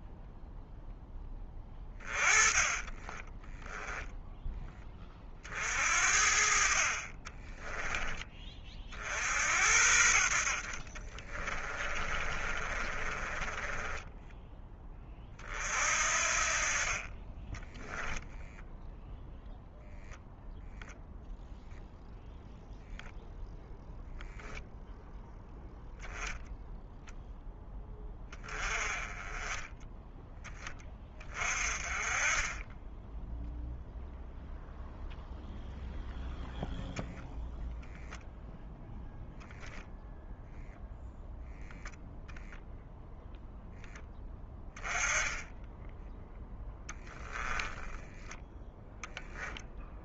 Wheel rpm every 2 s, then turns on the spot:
0, 20, 10, 50, 40, 50, 30, 20, 40, 0, 0, 0, 0, 0, 20, 20, 20, 0, 0, 0, 0, 0, 10, 10, 0.
2-4 12-14